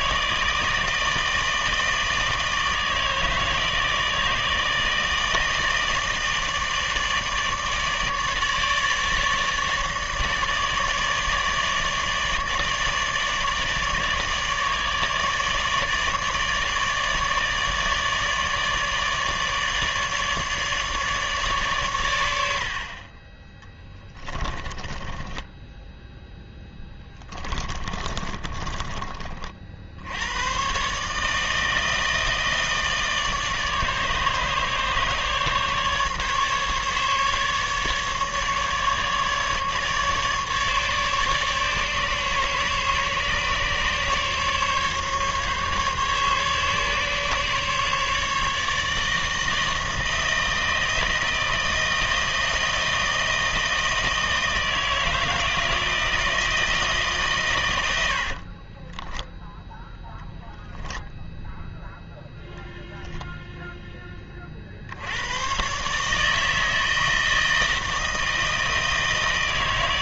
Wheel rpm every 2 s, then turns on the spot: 160, 160, 160, 160, 150, 150, 150, 150, 150, 150, 150, 70, 20, 10, 30, 120, 160, 150, 150, 150, 150, 140, 140, 140, 150, 160, 160, 160, 160, 30, 0, 0, 40, 160, 160.
24-30 58-60